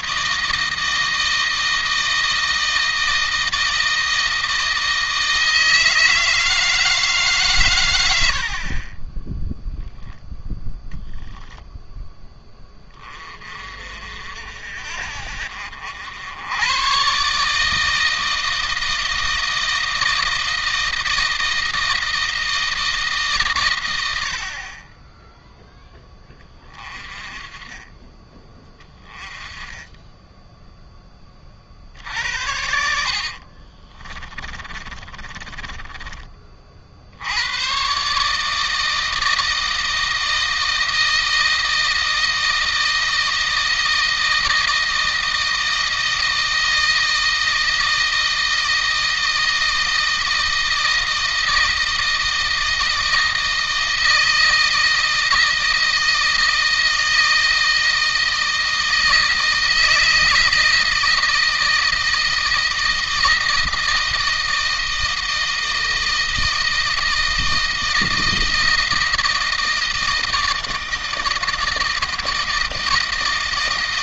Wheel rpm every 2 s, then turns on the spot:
160, 160, 160, 160, 40, 0, 20, 60, 100, 160, 160, 160, 40, 20, 20, 10, 80, 30, 50, 160, 160, 160, 160, 160, 160, 160, 160, 160, 160, 160, 160, 160, 160, 160, 160, 160, 160.
32-36